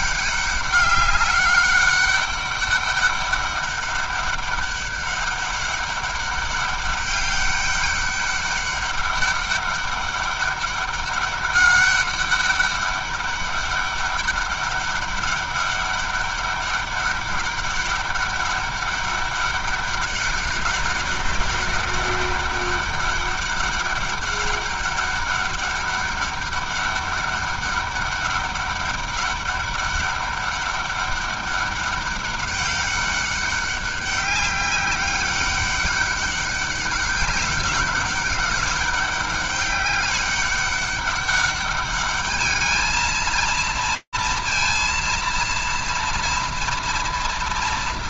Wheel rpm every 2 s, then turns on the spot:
200, 200, 200, 200, 200, 200, 200, 200, 200, 200, 200, 200, 200, 200, 200, 200, 200, 200, 200, 200, 200, 210, 230, 230.
none